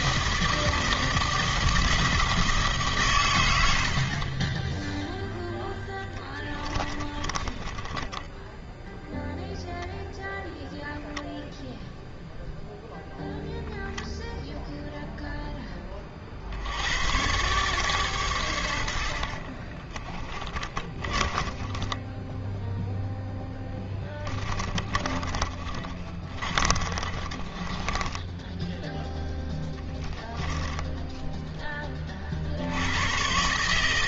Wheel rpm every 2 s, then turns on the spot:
160, 150, 10, 20, 0, 0, 0, 0, 110, 50, 20, 0, 20, 30, 0, 10, 100.
4-8 18-22 24-28 30-32